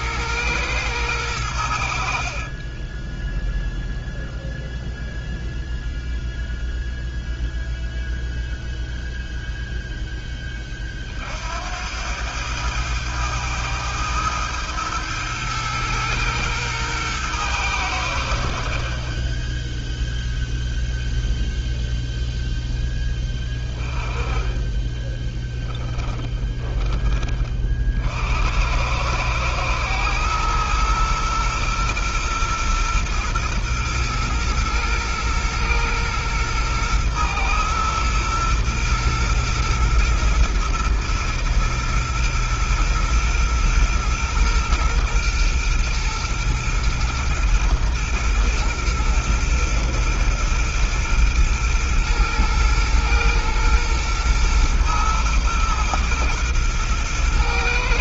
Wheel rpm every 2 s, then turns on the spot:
110, 30, 0, 0, 0, 20, 100, 110, 110, 60, 0, 0, 20, 20, 80, 110, 120, 120, 120, 120, 110, 120, 120, 120, 120, 120, 120, 120, 120.
2-4